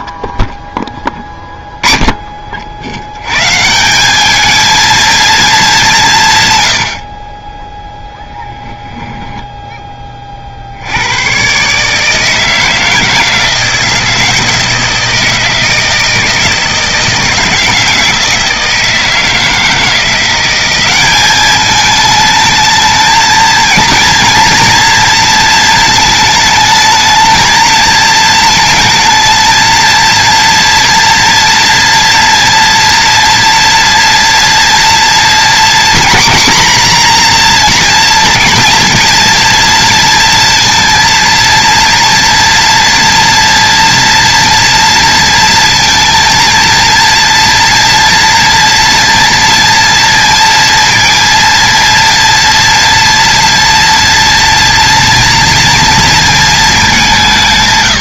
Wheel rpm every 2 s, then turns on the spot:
10, 90, 220, 80, 0, 90, 160, 160, 160, 160, 190, 220, 230, 220, 230, 240, 230, 230, 250, 230, 230, 230, 230, 230, 230, 230, 230, 230, 200.
none